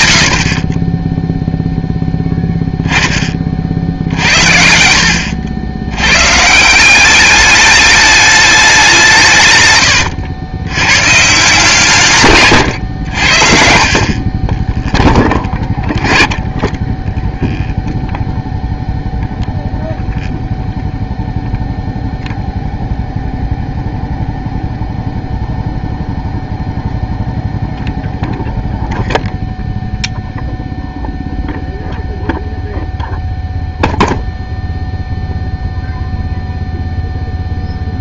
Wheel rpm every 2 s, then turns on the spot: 50, 10, 60, 160, 200, 100, 120, 20, 10, 0, 0, 0, 0, 0, 0, 0, 0, 0, 0.
none